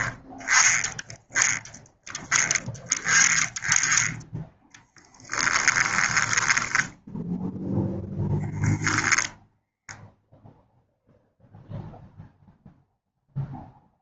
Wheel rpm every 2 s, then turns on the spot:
10, 10, 10, 10, 10, 0, 0.
4-6